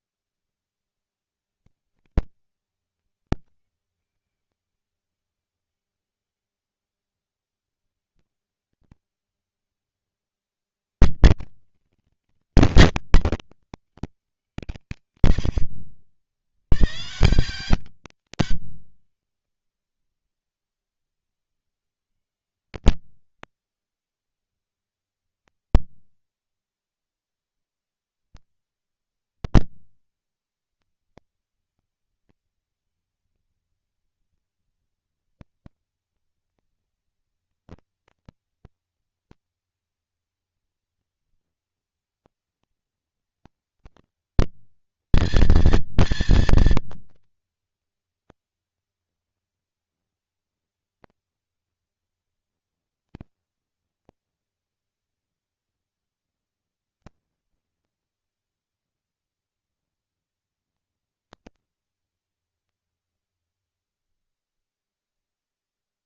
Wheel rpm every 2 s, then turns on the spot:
170, 200, 200, 200, 190, 120, 220, 150, 110, 160, 60, 100, 70, 20, 50, 70, 190, 230, 220, 230, 230, 220, 230, 230, 230, 230, 230, 240, 230, 230, 230, 210, 30.
64-66